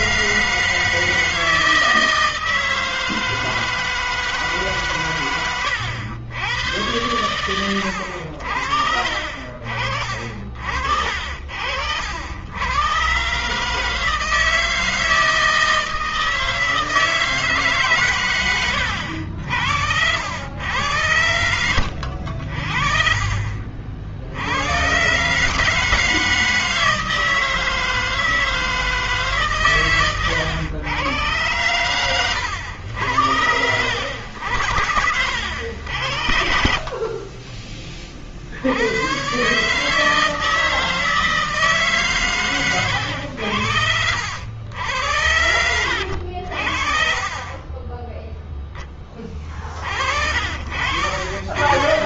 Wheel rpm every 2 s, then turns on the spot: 150, 160, 150, 100, 60, 50, 80, 160, 160, 110, 90, 60, 80, 160, 160, 110, 110, 70, 60, 60, 160, 120, 80, 60, 10, 40.
18-20